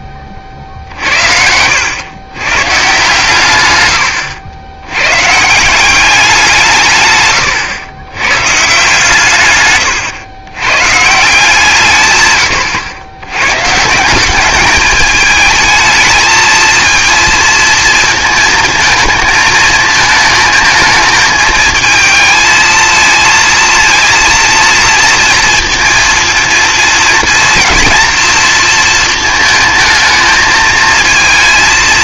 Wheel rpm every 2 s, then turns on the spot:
50, 130, 90, 160, 150, 130, 110, 200, 230, 220, 220, 220, 230, 230, 230, 220.
none